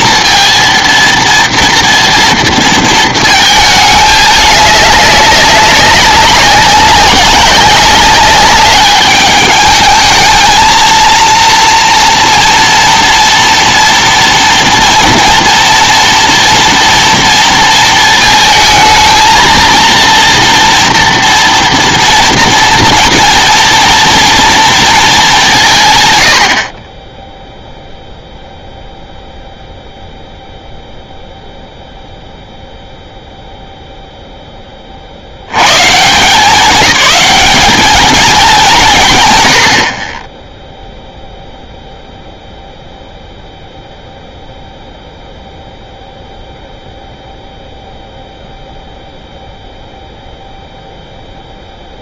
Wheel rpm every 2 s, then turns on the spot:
230, 230, 210, 190, 200, 220, 230, 240, 230, 220, 230, 230, 230, 50, 0, 0, 0, 20, 200, 190, 0, 0, 0, 0, 0, 0.
none